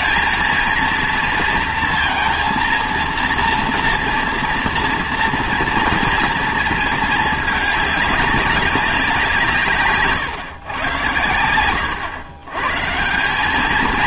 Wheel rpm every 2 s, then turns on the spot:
220, 230, 240, 230, 190, 130, 120.
none